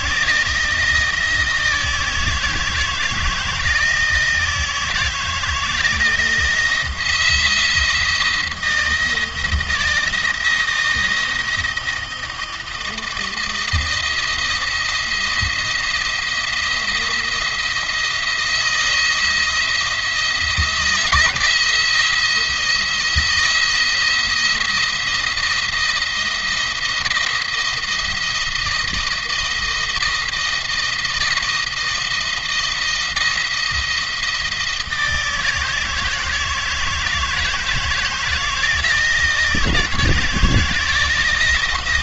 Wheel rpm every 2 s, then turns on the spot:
170, 160, 160, 170, 170, 170, 160, 170, 170, 170, 170, 170, 170, 170, 160, 160, 170, 160, 160, 160, 160.
none